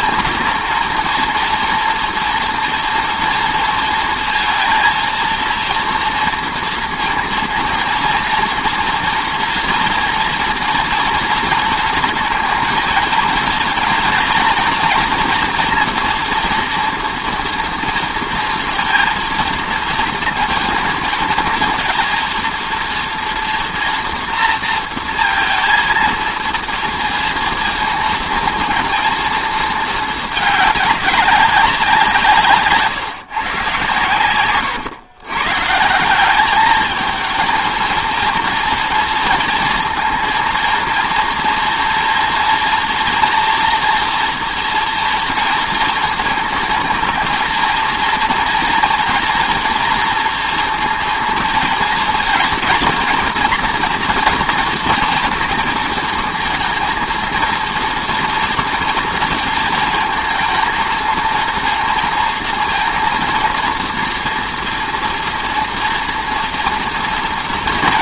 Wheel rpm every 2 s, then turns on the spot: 230, 230, 230, 230, 230, 230, 220, 240, 230, 230, 220, 230, 230, 230, 230, 200, 150, 130, 210, 230, 230, 230, 230, 220, 240, 230, 230, 230, 230, 230, 230, 230, 230, 230.
34-36